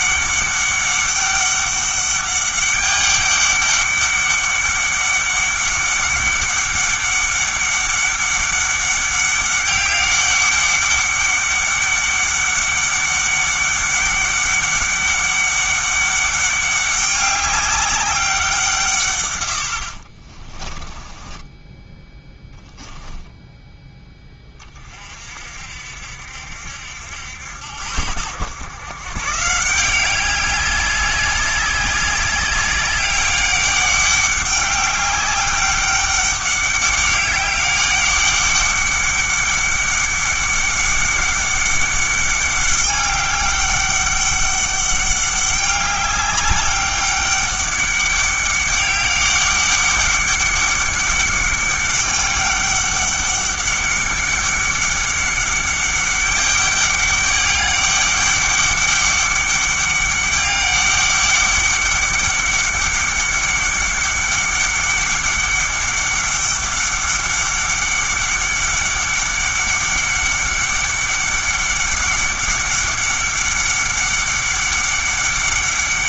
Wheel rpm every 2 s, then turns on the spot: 200, 200, 200, 200, 200, 200, 200, 200, 200, 160, 20, 10, 30, 70, 120, 190, 190, 200, 200, 200, 200, 200, 200, 200, 200, 200, 200, 200, 200, 200, 200, 200, 200, 200, 200, 200, 200, 200.
20-24